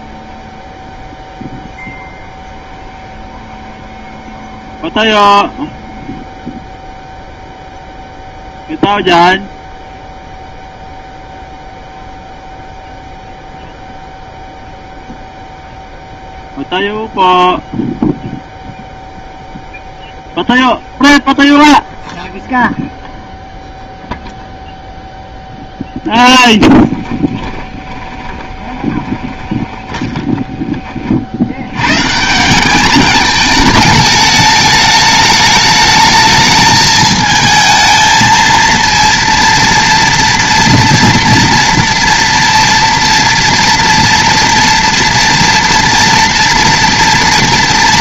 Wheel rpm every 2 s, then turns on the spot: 0, 0, 0, 0, 0, 0, 0, 0, 0, 0, 0, 0, 0, 20, 20, 40, 210, 210, 220, 230, 230, 230, 230, 240.
26-30